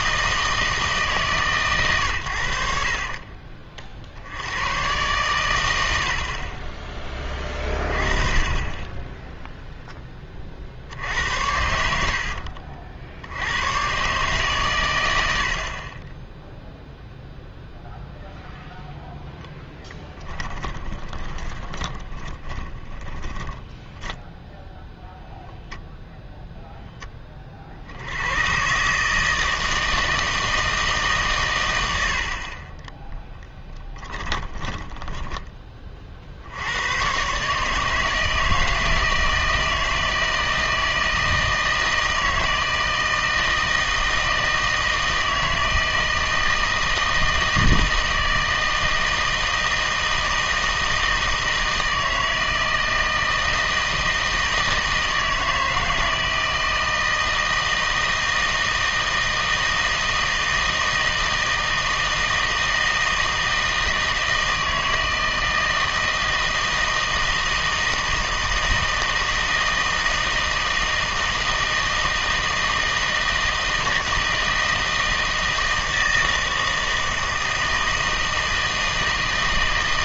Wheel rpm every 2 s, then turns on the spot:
160, 50, 110, 20, 10, 40, 60, 120, 0, 0, 20, 20, 0, 0, 140, 160, 20, 10, 90, 160, 160, 160, 160, 160, 160, 160, 160, 160, 160, 160, 160, 160, 160, 160, 160, 160, 160, 160, 160, 160.
20-24 32-36